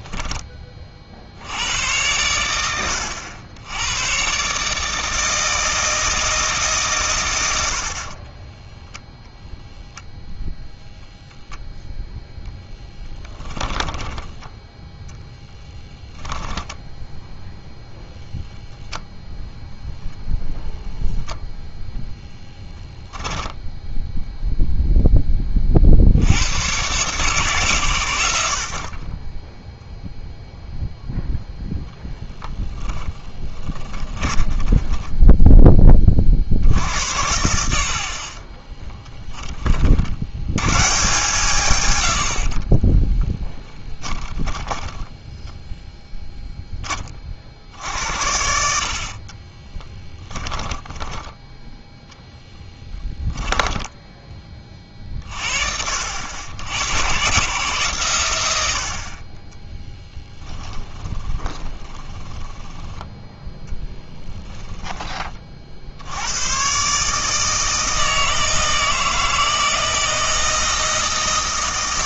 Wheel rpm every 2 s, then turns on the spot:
30, 90, 150, 140, 0, 0, 0, 10, 10, 0, 0, 10, 0, 110, 60, 0, 10, 10, 70, 20, 120, 40, 10, 20, 60, 10, 10, 40, 90, 80, 10, 10, 10, 130, 160, 160.
16-18 32-36 38-40 42-46 50-54 60-64